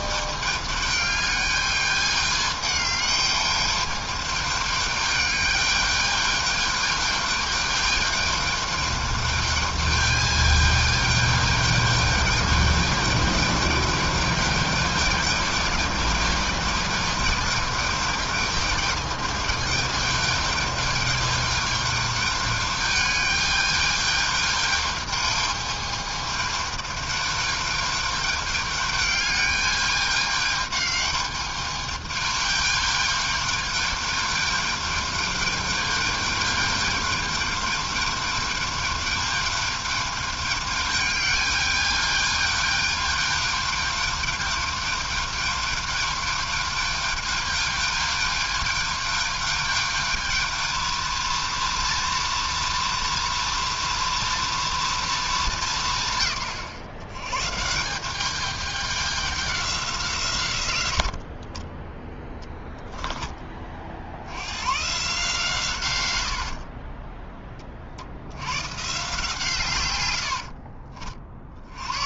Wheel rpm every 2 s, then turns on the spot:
210, 210, 210, 210, 210, 220, 210, 210, 220, 210, 210, 210, 210, 210, 210, 210, 210, 210, 210, 210, 210, 210, 210, 210, 210, 220, 230, 230, 130, 200, 110, 10, 100, 70, 100, 70.
66-68 70-72